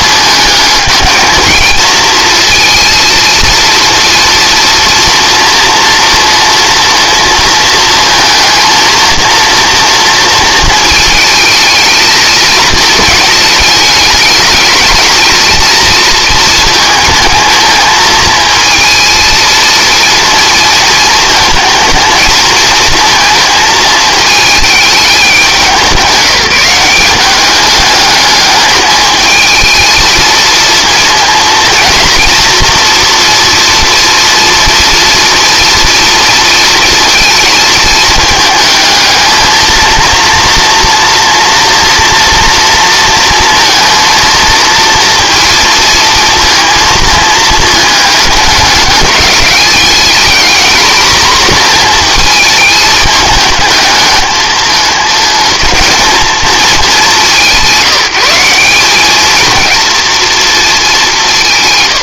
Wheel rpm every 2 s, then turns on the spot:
210, 230, 240, 230, 230, 220, 220, 220, 230, 220, 230, 220, 210, 190, 210, 230, 230, 230, 230, 220, 240, 230, 230, 230, 210, 230, 220, 210, 210, 190, 220.
none